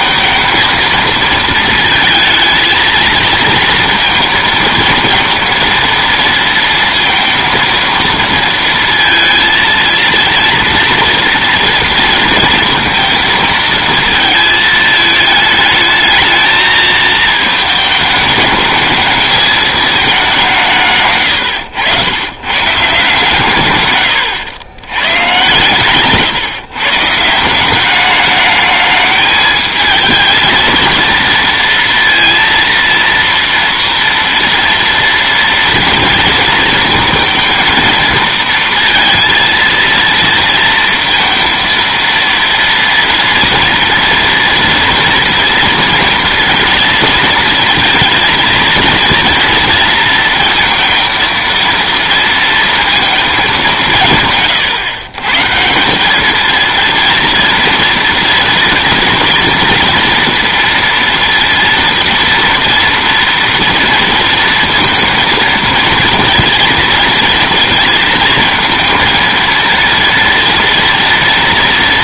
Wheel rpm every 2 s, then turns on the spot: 220, 220, 230, 230, 230, 230, 220, 220, 220, 220, 160, 140, 100, 150, 210, 230, 230, 230, 230, 230, 230, 230, 230, 240, 230, 230, 230, 130, 230, 230, 230, 230, 230, 230, 230, 230.
none